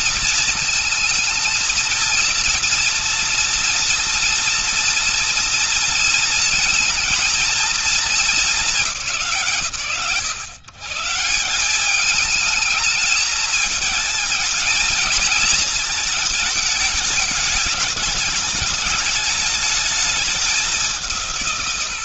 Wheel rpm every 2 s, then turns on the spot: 230, 230, 230, 230, 220, 130, 210, 220, 210, 210, 210.
none